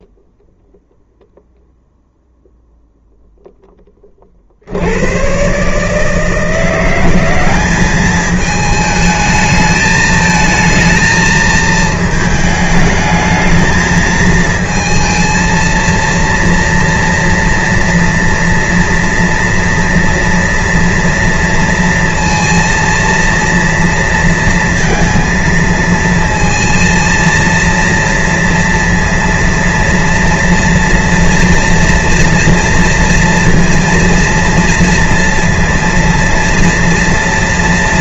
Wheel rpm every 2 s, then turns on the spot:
0, 0, 50, 160, 210, 220, 220, 220, 230, 240, 240, 230, 230, 220, 230, 230, 230, 230, 230.
none